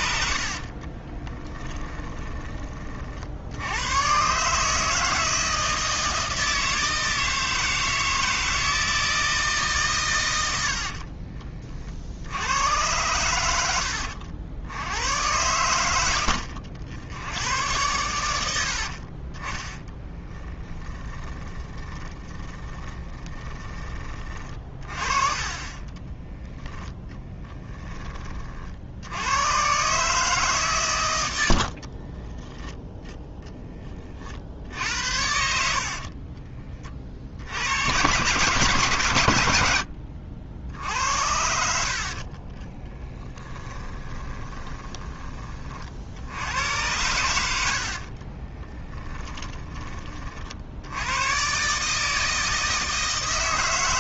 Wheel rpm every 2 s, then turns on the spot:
30, 30, 160, 160, 160, 70, 100, 90, 70, 60, 10, 20, 30, 10, 70, 120, 10, 70, 30, 140, 70, 20, 10, 90, 10, 90, 160.
0-2 10-12 20-24 42-44